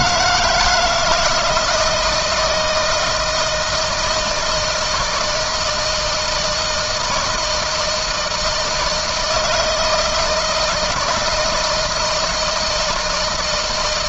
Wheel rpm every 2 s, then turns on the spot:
170, 160, 160, 160, 160, 160, 160.
none